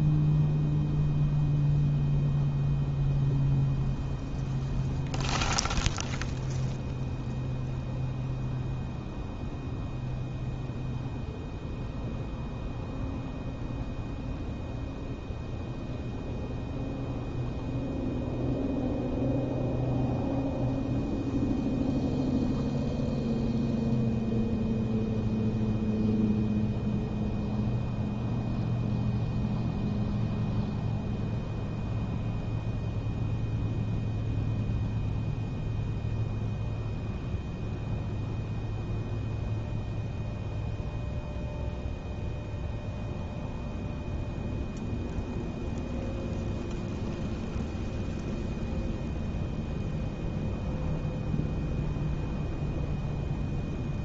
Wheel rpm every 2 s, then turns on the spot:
0, 0, 0, 0, 0, 0, 0, 0, 0, 0, 0, 0, 0, 0, 0, 0, 0, 0, 0, 0, 0, 0, 0, 0, 0, 0, 0.
none